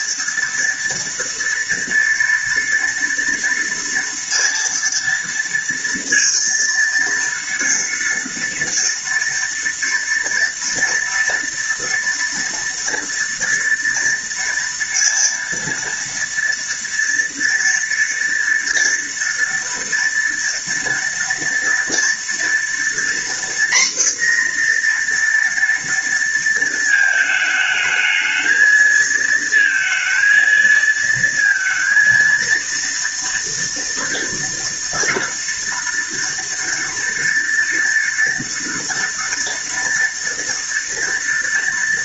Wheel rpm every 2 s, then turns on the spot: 230, 240, 230, 230, 230, 230, 230, 230, 230, 230, 230, 240, 240, 220, 230, 230, 230, 230, 230, 240, 230.
none